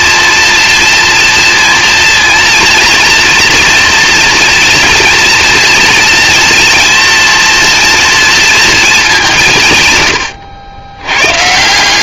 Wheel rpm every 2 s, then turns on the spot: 230, 240, 230, 230, 190, 110.
none